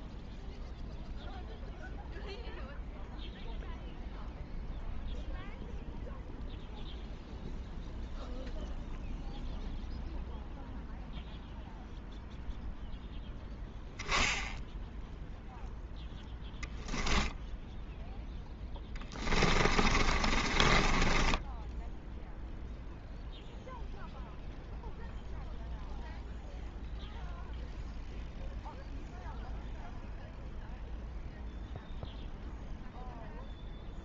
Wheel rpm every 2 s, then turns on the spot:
0, 0, 0, 0, 0, 0, 0, 0, 10, 10, 30, 0, 0, 0, 0, 0, 0.
18-22